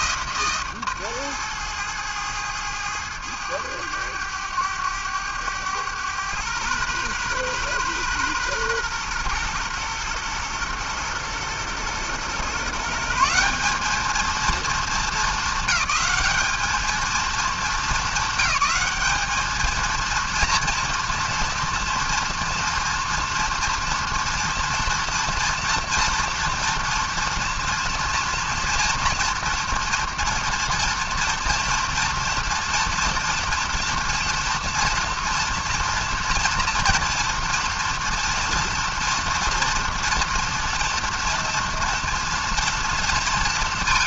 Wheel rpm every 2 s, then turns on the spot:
150, 110, 100, 120, 120, 120, 140, 220, 210, 210, 230, 240, 230, 240, 230, 230, 230, 240, 230, 240, 230, 230.
none